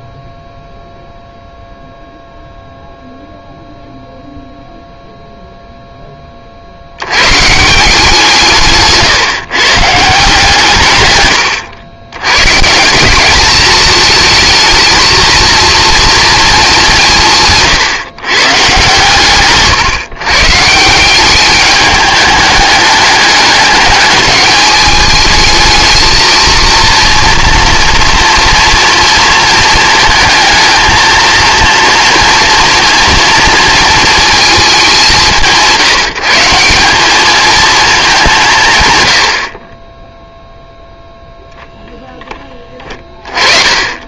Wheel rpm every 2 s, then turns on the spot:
0, 0, 0, 80, 140, 140, 160, 220, 190, 130, 160, 210, 210, 230, 230, 220, 230, 190, 190, 140, 0, 20.
none